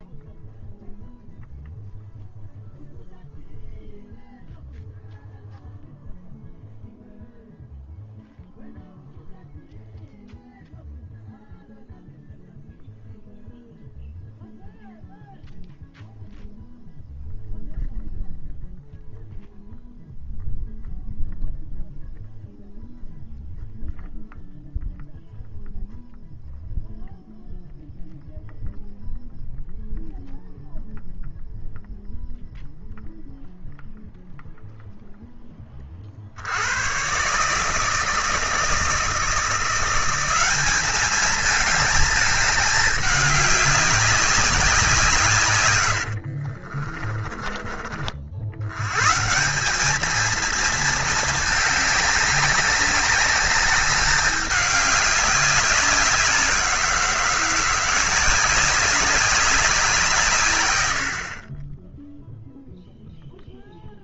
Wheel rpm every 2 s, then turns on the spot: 0, 0, 0, 0, 0, 0, 0, 0, 0, 0, 0, 0, 0, 0, 0, 0, 0, 0, 110, 160, 210, 210, 170, 40, 110, 220, 190, 200, 170, 190, 80, 0.
46-48